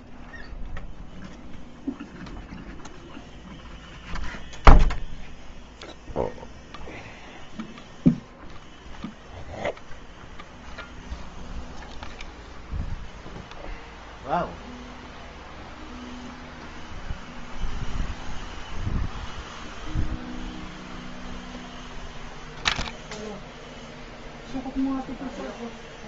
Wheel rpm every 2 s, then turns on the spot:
0, 0, 0, 0, 0, 0, 0, 0, 0, 0, 0, 0, 0.
none